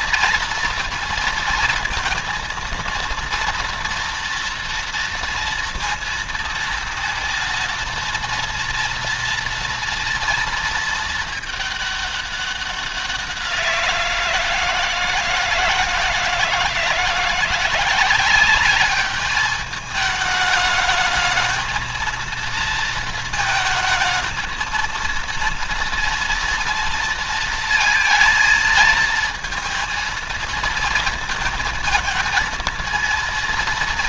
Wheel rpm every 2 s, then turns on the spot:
230, 230, 230, 230, 230, 230, 190, 160, 160, 200, 220, 220, 230, 230, 220, 220, 230.
none